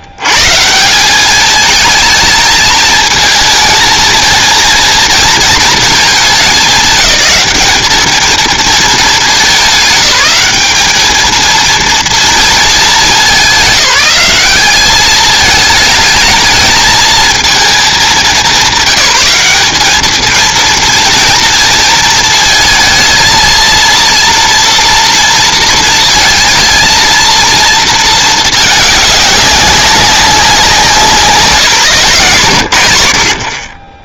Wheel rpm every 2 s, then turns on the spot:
110, 220, 220, 220, 220, 210, 230, 190, 220, 190, 220, 230, 230, 230, 220, 190, 120.
none